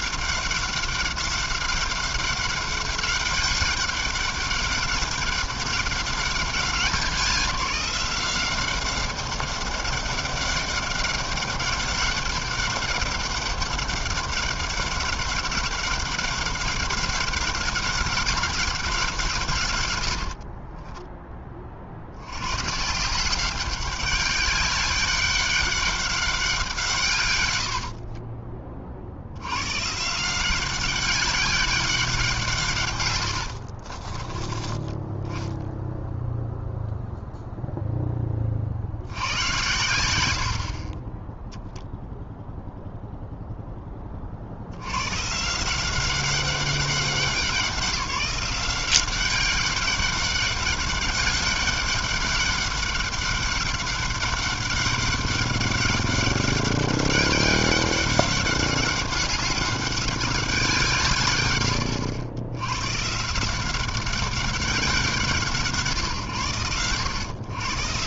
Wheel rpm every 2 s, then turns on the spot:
200, 200, 200, 190, 190, 200, 200, 200, 200, 160, 10, 180, 200, 130, 80, 200, 90, 10, 0, 90, 10, 0, 150, 190, 190, 200, 200, 200, 200, 200, 130, 160, 150, 120.
32-34 40-42